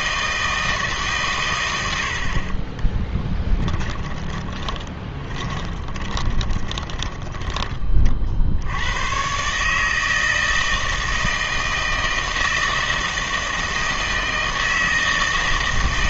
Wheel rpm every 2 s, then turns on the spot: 160, 30, 20, 20, 80, 160, 160, 160.
2-8